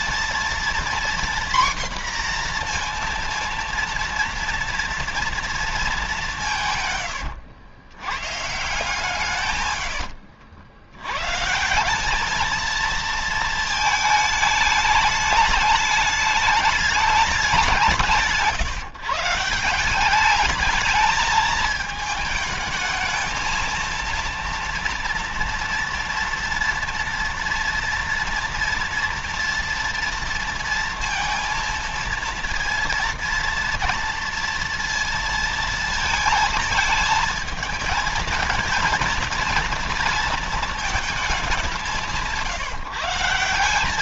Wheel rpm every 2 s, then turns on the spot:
240, 240, 230, 150, 140, 90, 220, 210, 210, 170, 210, 220, 230, 230, 230, 230, 230, 230, 220, 230, 220, 160.
none